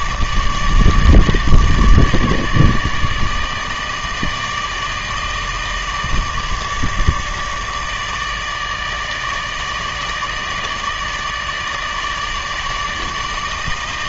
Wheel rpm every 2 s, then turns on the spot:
150, 150, 160, 160, 160, 160, 160.
none